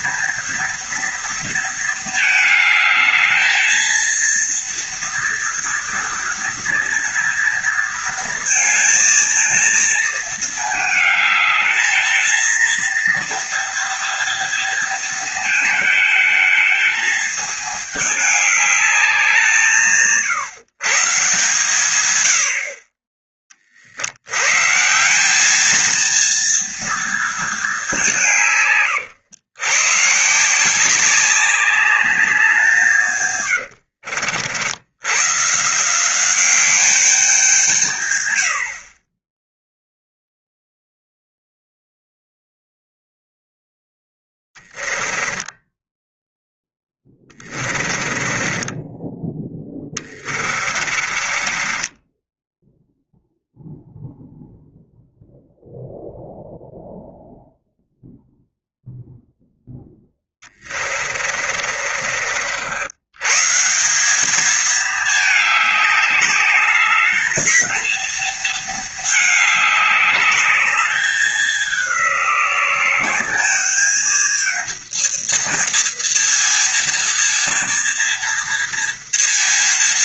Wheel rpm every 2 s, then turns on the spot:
230, 220, 230, 230, 230, 220, 230, 230, 220, 200, 140, 30, 170, 230, 130, 180, 150, 100, 190, 40, 0, 0, 10, 10, 10, 30, 0, 0, 0, 0, 30, 100, 220, 220, 220, 210, 190, 230, 230, 230.
44-52 60-62